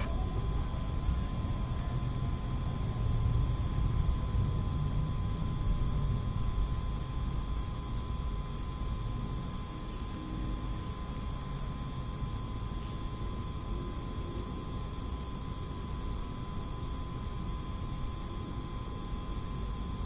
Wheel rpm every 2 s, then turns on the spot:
0, 0, 0, 0, 0, 0, 0, 0, 0, 0.
none